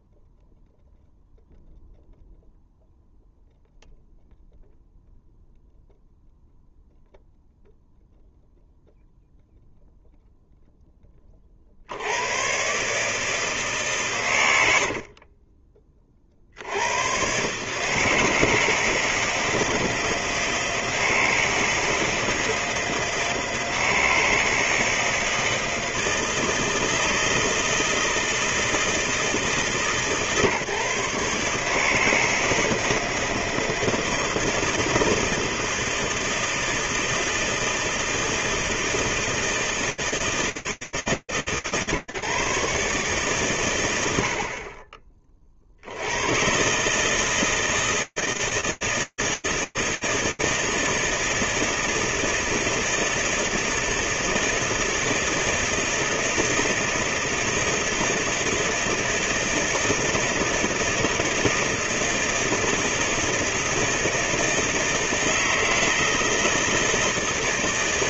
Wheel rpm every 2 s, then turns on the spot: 0, 0, 0, 0, 0, 0, 120, 90, 70, 160, 160, 160, 160, 160, 160, 150, 160, 160, 160, 160, 160, 140, 90, 100, 160, 160, 160, 160, 160, 160, 160, 160, 160, 160.
none